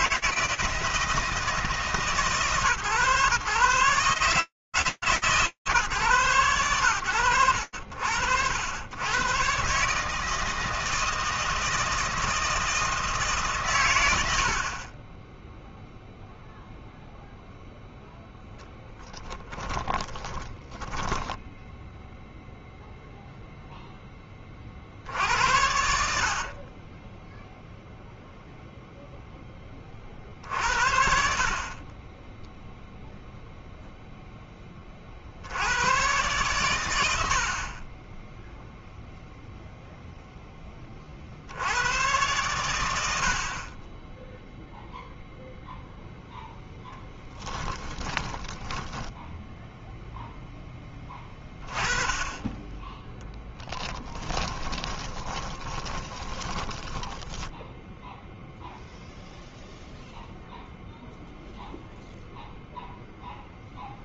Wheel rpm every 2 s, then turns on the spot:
160, 130, 150, 80, 130, 160, 130, 0, 0, 10, 10, 0, 60, 20, 0, 40, 0, 40, 100, 0, 30, 70, 0, 0, 20, 10, 10, 20, 20, 0, 0, 0.
18-22 48-50 54-58